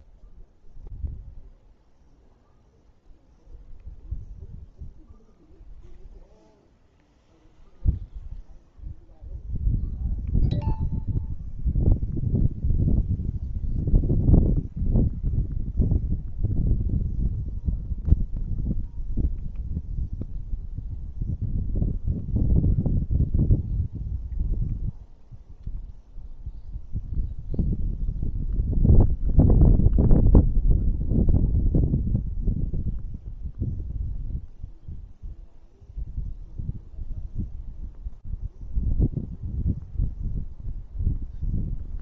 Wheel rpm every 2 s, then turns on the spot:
0, 0, 0, 0, 0, 0, 0, 0, 0, 0, 0, 0, 0, 0, 0, 0, 0, 0, 0, 0, 0.
none